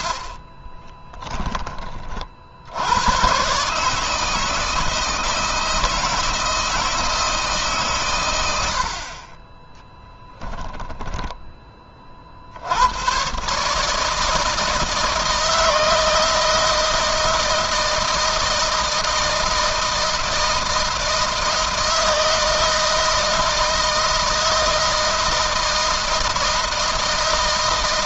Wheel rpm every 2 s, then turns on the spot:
30, 90, 160, 160, 70, 10, 100, 160, 160, 160, 160, 160, 160, 160.
0-2 10-12